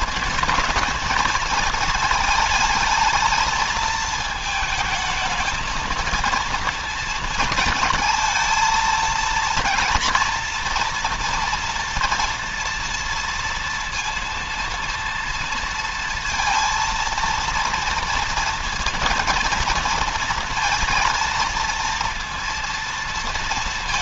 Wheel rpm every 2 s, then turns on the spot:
230, 220, 220, 230, 230, 230, 230, 230, 230, 230, 230, 230.
none